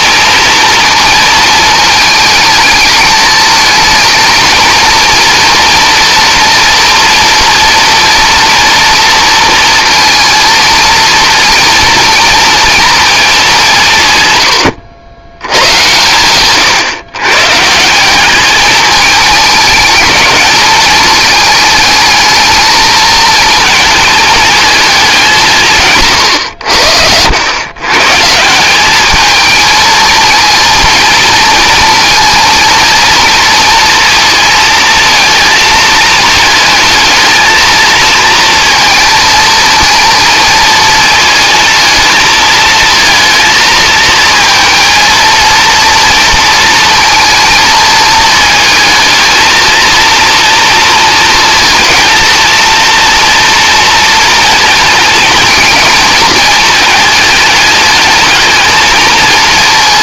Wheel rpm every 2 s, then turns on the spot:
230, 220, 230, 230, 230, 230, 230, 90, 120, 210, 210, 220, 210, 80, 190, 230, 230, 220, 220, 230, 220, 230, 230, 230, 220, 230, 230, 230, 220, 220.
none